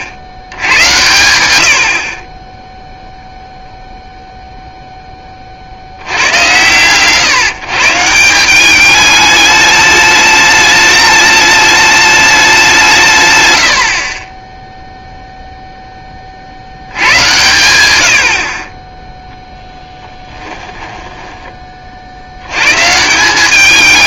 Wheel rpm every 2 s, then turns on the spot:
130, 10, 20, 110, 210, 210, 170, 0, 110, 10, 10, 150.
20-22